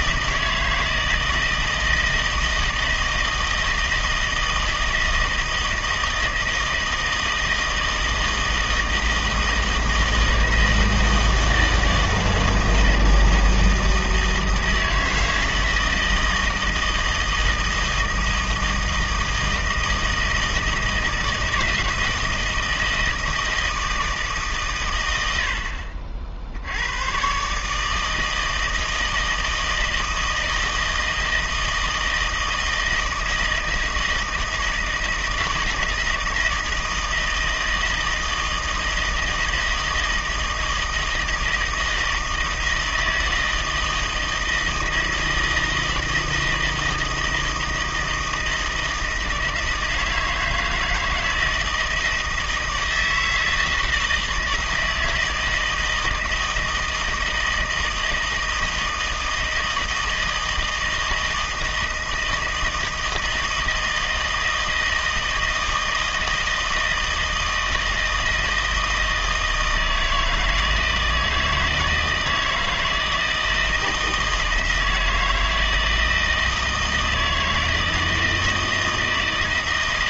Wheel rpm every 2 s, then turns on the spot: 160, 160, 160, 160, 160, 160, 160, 160, 160, 160, 160, 160, 140, 80, 160, 160, 160, 160, 160, 160, 160, 160, 160, 160, 160, 160, 160, 160, 160, 160, 160, 160, 160, 160, 160, 160, 160, 160, 160, 160.
none